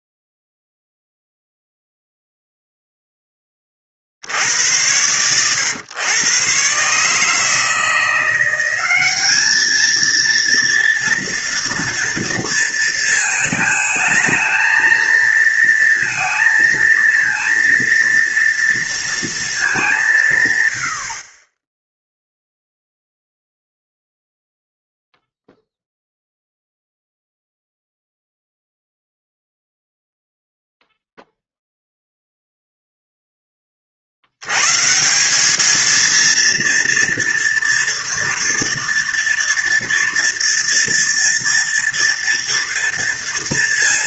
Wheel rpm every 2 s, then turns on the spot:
0, 0, 80, 130, 180, 230, 230, 220, 230, 240, 130, 0, 0, 0, 0, 0, 0, 100, 230, 230, 240, 230.
none